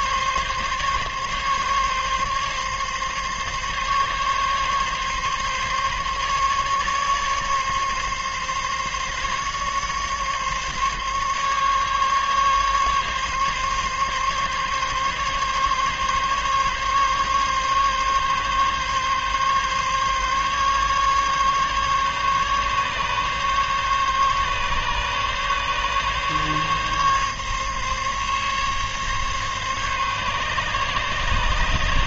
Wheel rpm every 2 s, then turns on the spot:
140, 140, 140, 140, 140, 140, 140, 140, 140, 140, 140, 140, 140, 140, 140, 140.
none